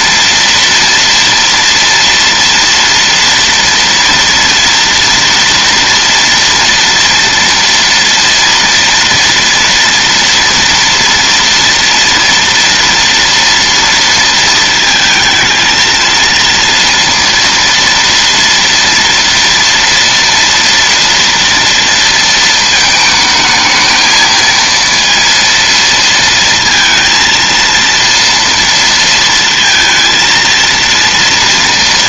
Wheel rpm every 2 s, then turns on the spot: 230, 230, 230, 230, 230, 230, 230, 230, 230, 240, 230, 230, 220, 230, 230, 230.
none